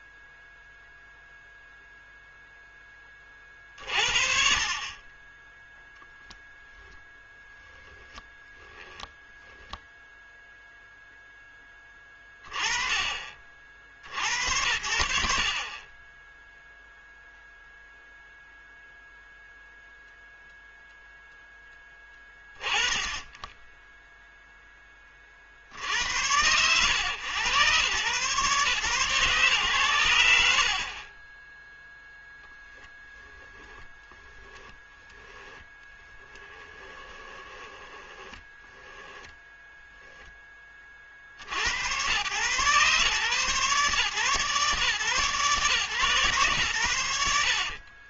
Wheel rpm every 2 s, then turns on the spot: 0, 0, 40, 0, 10, 0, 30, 80, 10, 0, 0, 30, 10, 110, 120, 60, 0, 10, 20, 10, 20, 130, 130, 120.
8-10 34-40